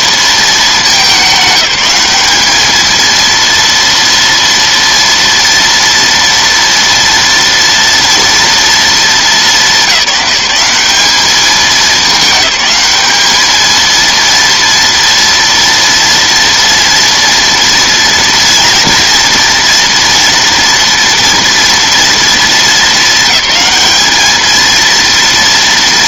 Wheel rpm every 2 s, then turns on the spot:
210, 220, 230, 230, 220, 190, 210, 230, 230, 230, 230, 220, 220.
none